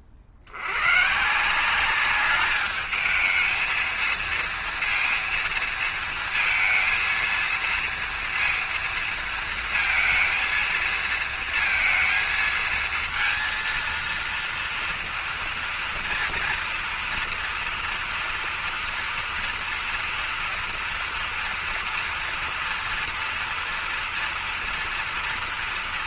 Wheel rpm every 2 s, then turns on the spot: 80, 210, 230, 230, 230, 230, 230, 230, 230, 230, 230, 230, 230.
none